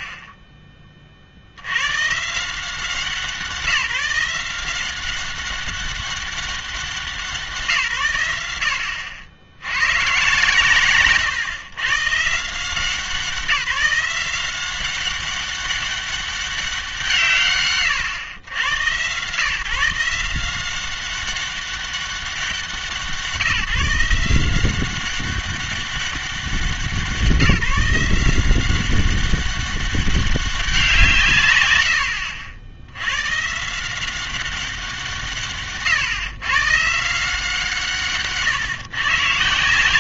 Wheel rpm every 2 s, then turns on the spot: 40, 170, 180, 190, 90, 130, 160, 180, 190, 120, 180, 180, 180, 180, 180, 180, 80, 190, 140, 140.
none